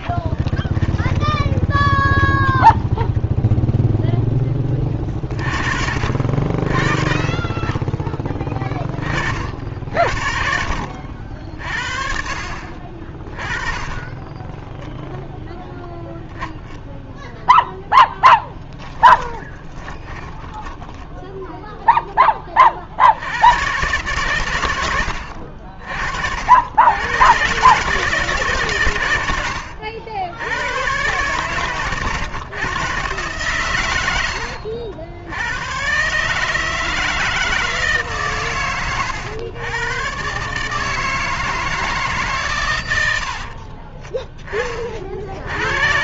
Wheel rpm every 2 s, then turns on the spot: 20, 0, 30, 30, 50, 50, 20, 20, 0, 20, 0, 100, 60, 130, 100, 130, 120, 100, 160, 100, 160, 70, 40.
0-2 18-20